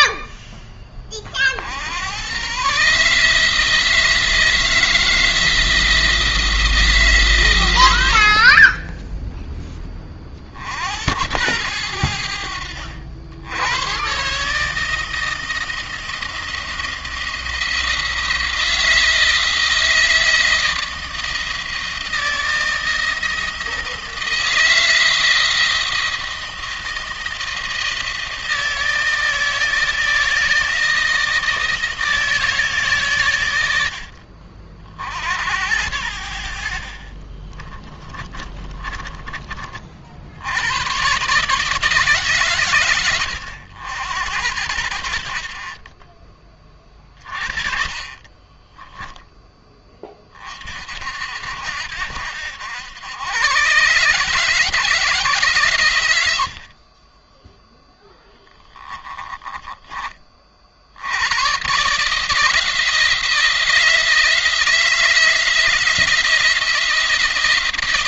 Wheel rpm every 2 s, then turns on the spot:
20, 130, 160, 160, 30, 60, 70, 150, 170, 160, 160, 160, 160, 160, 160, 160, 140, 50, 40, 30, 90, 130, 80, 30, 20, 50, 90, 170, 50, 20, 60, 160, 160, 170.
38-40 48-50 56-60